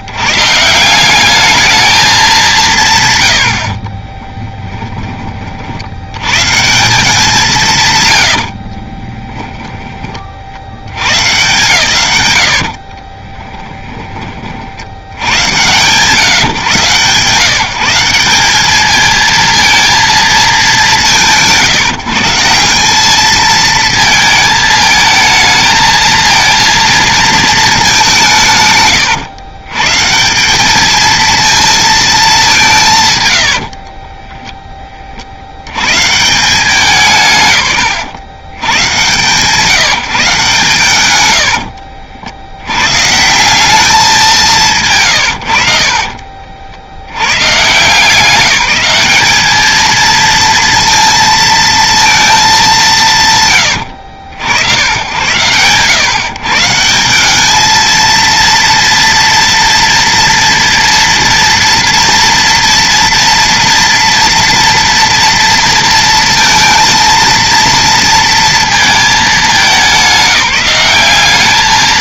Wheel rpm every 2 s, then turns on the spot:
170, 170, 10, 160, 60, 80, 60, 30, 140, 210, 200, 170, 220, 220, 130, 210, 200, 20, 170, 110, 130, 120, 160, 50, 200, 230, 200, 80, 170, 230, 240, 230, 230, 230, 220, 190.
4-6 8-10 12-14